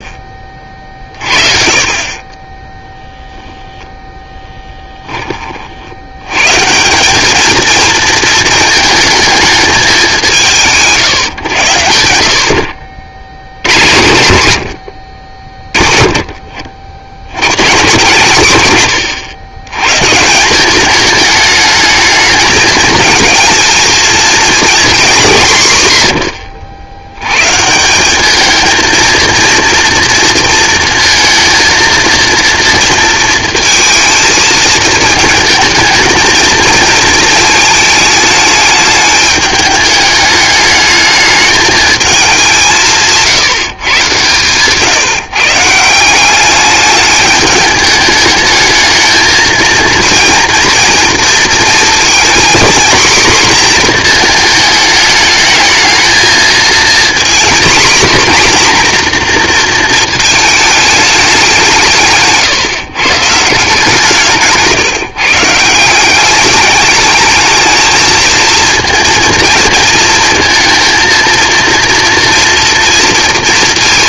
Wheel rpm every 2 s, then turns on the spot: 40, 10, 10, 150, 220, 160, 60, 80, 60, 130, 190, 220, 240, 80, 220, 230, 230, 220, 220, 210, 210, 180, 140, 210, 220, 240, 230, 220, 230, 250, 220, 140, 150, 210, 230, 230, 230.
4-6